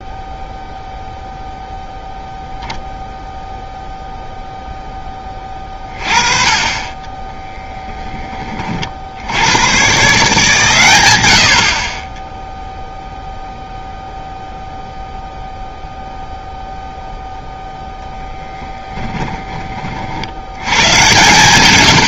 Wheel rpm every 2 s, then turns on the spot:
0, 0, 0, 30, 30, 130, 0, 0, 0, 10, 100.
18-20